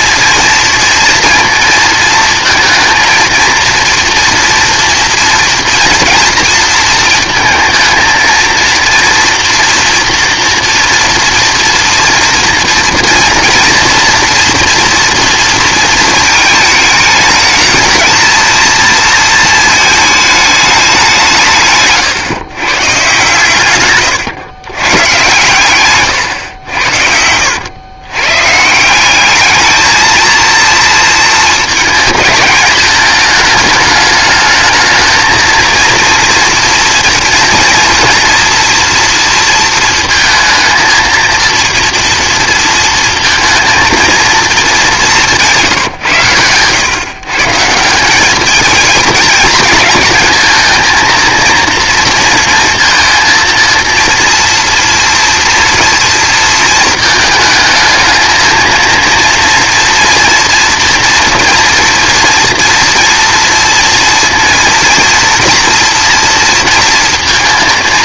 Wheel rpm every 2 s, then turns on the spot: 230, 230, 240, 230, 230, 230, 240, 230, 220, 230, 200, 130, 110, 90, 160, 230, 210, 220, 240, 230, 230, 230, 210, 120, 220, 220, 230, 230, 230, 230, 240, 230, 230, 230.
none